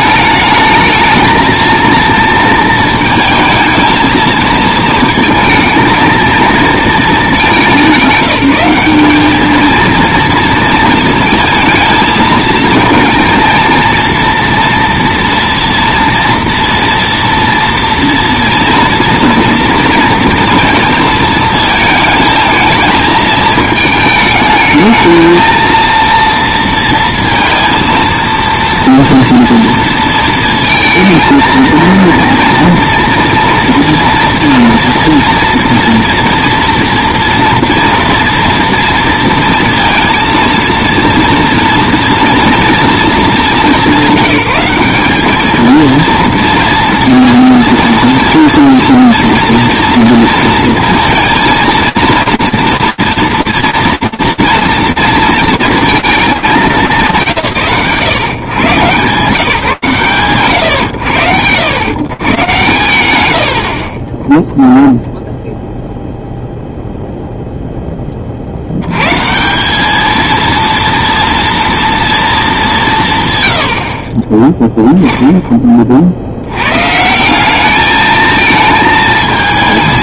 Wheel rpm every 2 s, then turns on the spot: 210, 230, 220, 220, 190, 230, 220, 230, 230, 230, 230, 220, 220, 230, 230, 230, 230, 240, 230, 230, 230, 230, 200, 230, 230, 230, 230, 230, 170, 140, 90, 60, 0, 0, 170, 230, 110, 10, 180, 220.
none